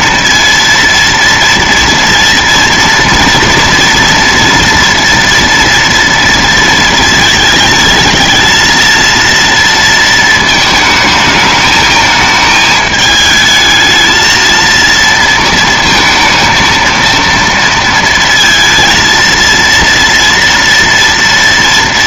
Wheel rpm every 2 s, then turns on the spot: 230, 230, 230, 230, 220, 220, 220, 230, 230, 230, 230.
none